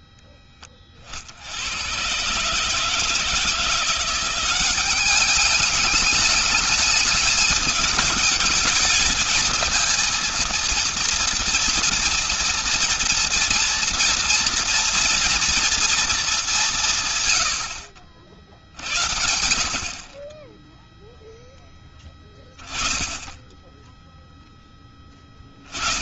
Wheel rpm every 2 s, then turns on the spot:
60, 160, 200, 210, 220, 230, 230, 230, 100, 70, 0, 10, 10.
none